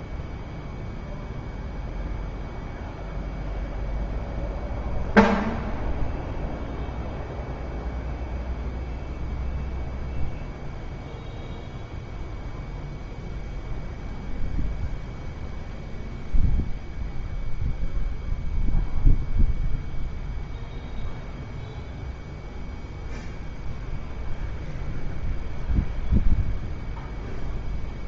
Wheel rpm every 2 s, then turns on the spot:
0, 0, 0, 0, 0, 0, 0, 0, 0, 0, 0, 0, 0, 0.
none